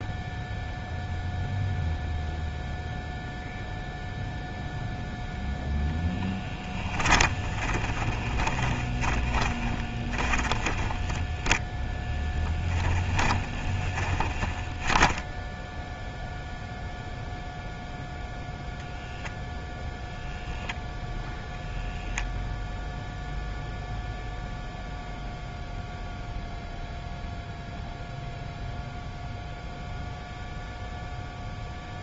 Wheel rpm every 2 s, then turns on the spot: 0, 0, 0, 10, 20, 20, 10, 10, 0, 0, 0, 0, 0, 0, 0, 0.
6-16